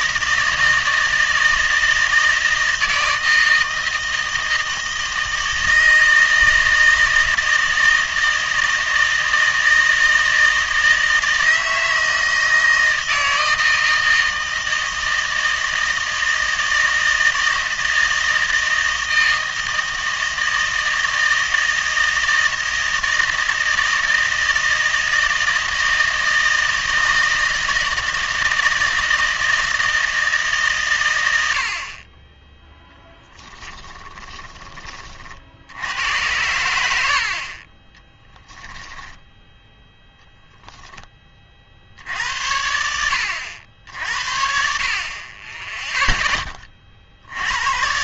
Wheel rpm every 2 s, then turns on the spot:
160, 160, 160, 160, 160, 160, 160, 160, 160, 160, 160, 160, 160, 160, 160, 140, 10, 20, 100, 10, 0, 70, 50, 20.
38-40